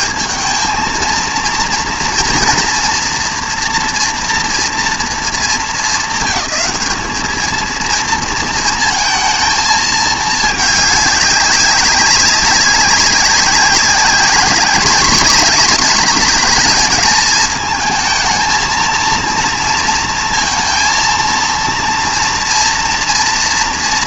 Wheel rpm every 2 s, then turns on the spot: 200, 240, 240, 220, 230, 210, 200, 220, 220, 230, 230, 230.
none